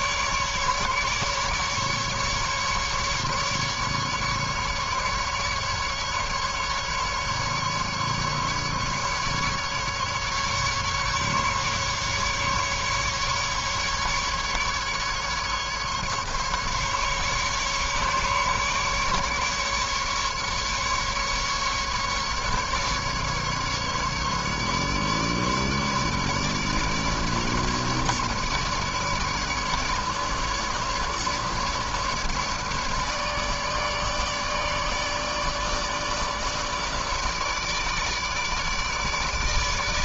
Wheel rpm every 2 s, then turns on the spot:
150, 150, 150, 150, 140, 150, 150, 140, 140, 140, 150, 140, 150, 150, 150, 150, 150, 150, 150, 150.
none